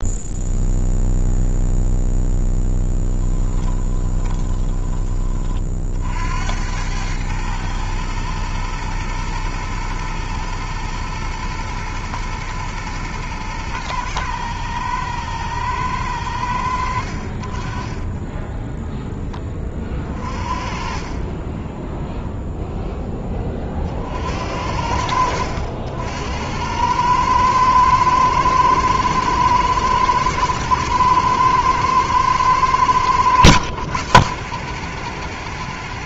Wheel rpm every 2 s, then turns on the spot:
0, 10, 20, 80, 120, 120, 110, 110, 90, 10, 30, 0, 60, 90, 110, 110, 110, 100.
4-6 18-20